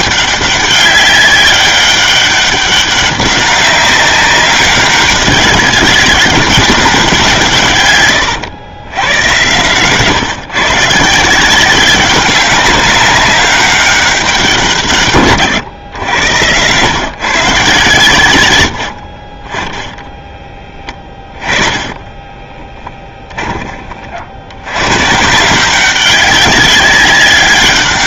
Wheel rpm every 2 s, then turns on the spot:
200, 200, 200, 190, 110, 150, 190, 150, 120, 80, 20, 10, 110, 190.
22-24